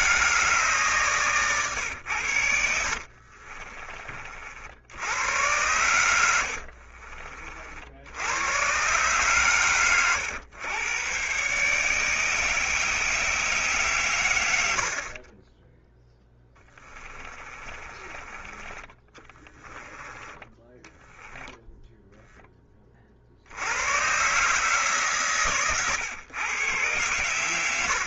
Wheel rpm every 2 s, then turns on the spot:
130, 50, 80, 50, 120, 110, 150, 70, 20, 20, 10, 30, 140, 120.
2-4 6-8 16-18 20-22